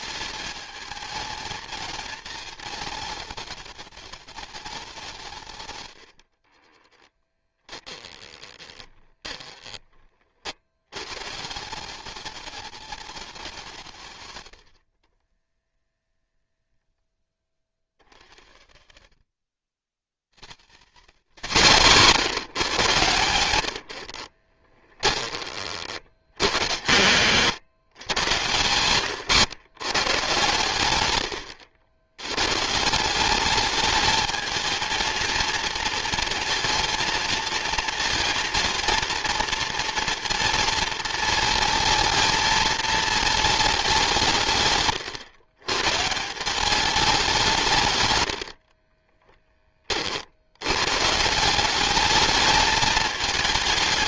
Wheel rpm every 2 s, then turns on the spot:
210, 210, 190, 30, 30, 90, 200, 70, 0, 60, 120, 150, 20, 100, 120, 110, 160, 220, 230, 230, 230, 220, 140, 190, 60, 110, 220.
6-10 24-26 28-30 48-50